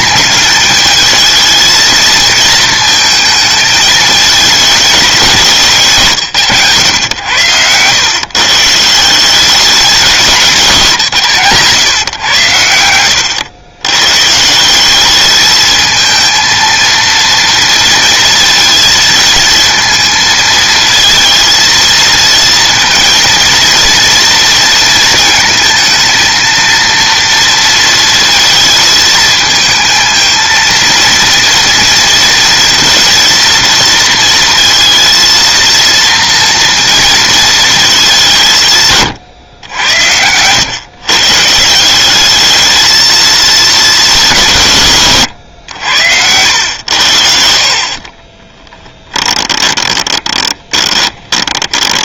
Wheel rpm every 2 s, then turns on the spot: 220, 220, 200, 100, 160, 170, 110, 180, 230, 230, 220, 230, 230, 230, 220, 230, 230, 230, 230, 140, 120, 220, 140, 90, 10, 20.
48-52